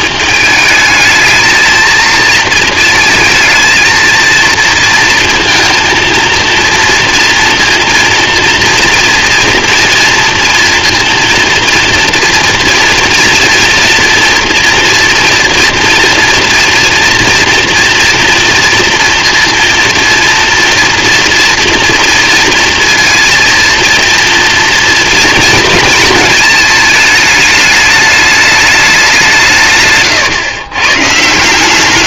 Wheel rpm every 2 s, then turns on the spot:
220, 230, 230, 230, 230, 230, 230, 230, 230, 230, 230, 230, 230, 220, 210, 120.
none